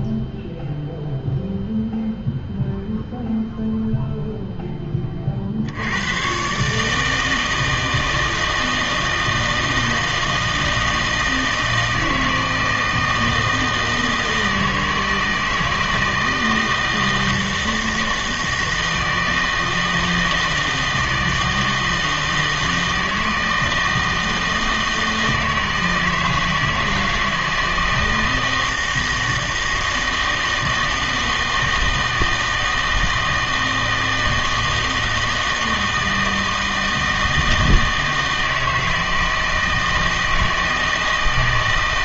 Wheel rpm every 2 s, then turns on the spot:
0, 0, 10, 150, 160, 160, 160, 160, 160, 160, 160, 160, 160, 160, 160, 160, 160, 160, 160, 160, 160.
none